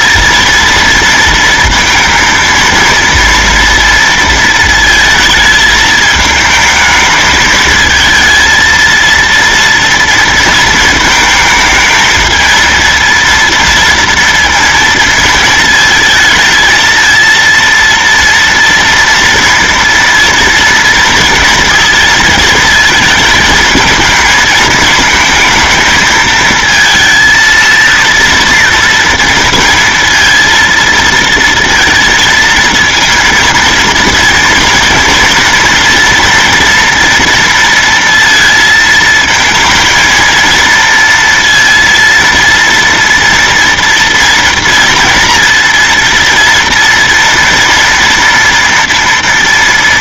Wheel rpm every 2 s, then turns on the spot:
230, 220, 230, 220, 230, 230, 220, 230, 220, 230, 230, 230, 220, 220, 230, 230, 230, 230, 230, 230, 230, 230, 230, 230, 230.
none